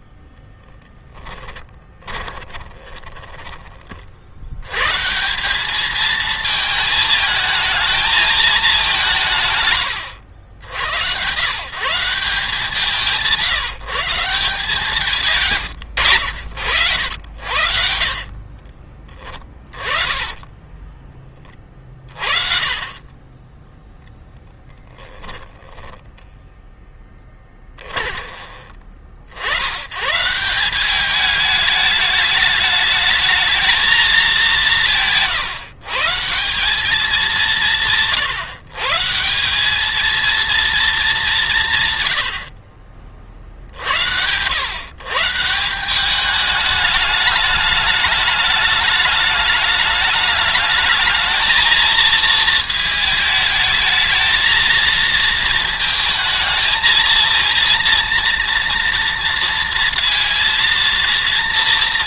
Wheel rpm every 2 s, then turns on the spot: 10, 40, 140, 220, 190, 100, 160, 150, 70, 30, 30, 30, 10, 10, 50, 190, 210, 160, 190, 150, 210, 40, 130, 210, 210, 220, 220, 230, 230, 230, 230.
2-4 14-16 18-22 24-28